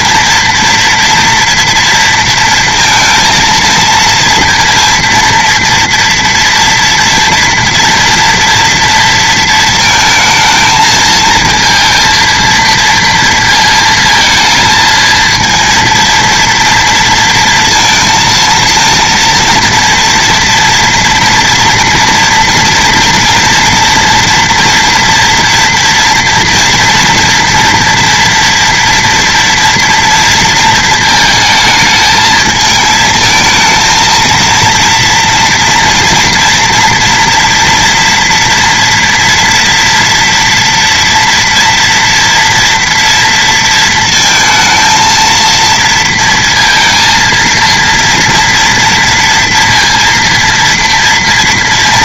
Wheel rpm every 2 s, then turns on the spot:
230, 230, 230, 230, 230, 220, 230, 220, 230, 230, 230, 240, 230, 230, 230, 220, 220, 230, 230, 230, 230, 230, 230, 230, 230, 230.
none